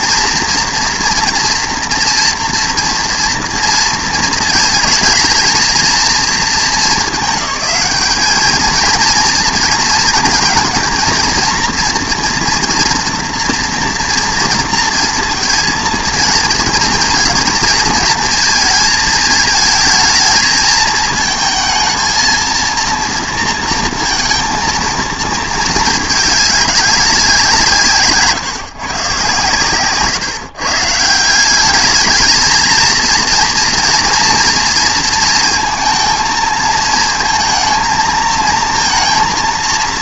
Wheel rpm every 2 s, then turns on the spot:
240, 230, 220, 220, 220, 230, 230, 230, 230, 220, 220, 230, 230, 210, 140, 140, 220, 230, 220, 230.
none